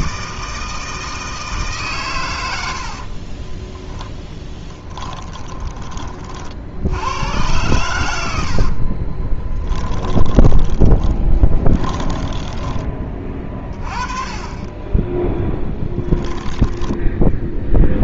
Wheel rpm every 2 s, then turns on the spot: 160, 80, 10, 80, 40, 20, 20, 10, 10.
2-6 8-12